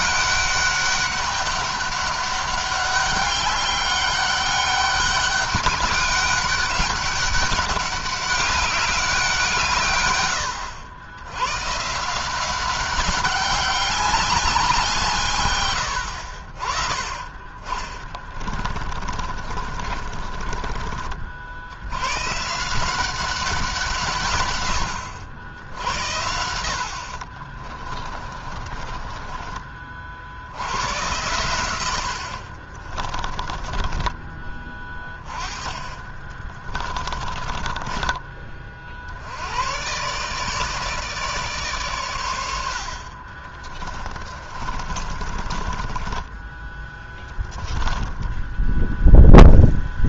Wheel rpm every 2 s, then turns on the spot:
200, 200, 200, 200, 190, 100, 200, 150, 30, 40, 50, 180, 80, 70, 30, 100, 30, 20, 20, 50, 150, 50, 40, 10, 0.
18-20 26-30 32-34 36-38 42-46